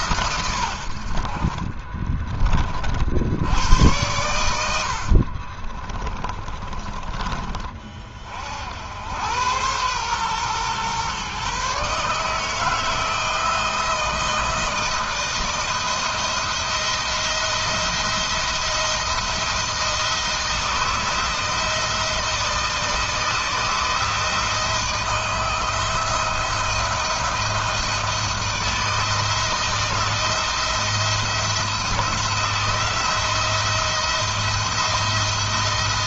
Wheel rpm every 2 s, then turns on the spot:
70, 60, 50, 30, 80, 120, 160, 170, 170, 170, 170, 160, 170, 170, 170, 170, 170, 170.
4-6